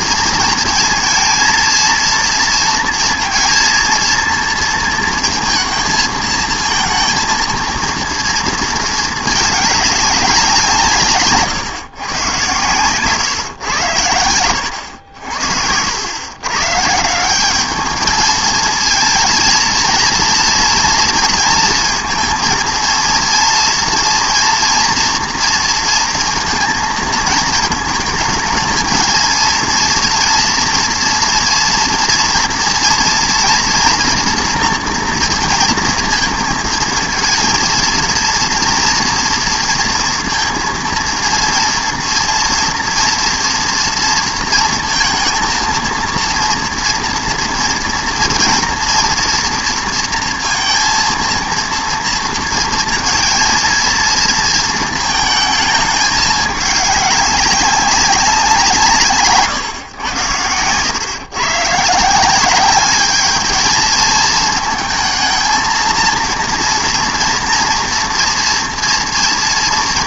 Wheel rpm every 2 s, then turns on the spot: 230, 230, 230, 230, 230, 180, 120, 90, 120, 220, 230, 230, 230, 230, 220, 230, 230, 230, 220, 230, 230, 230, 230, 230, 230, 230, 230, 230, 210, 180, 110, 190, 220, 230, 230.
60-62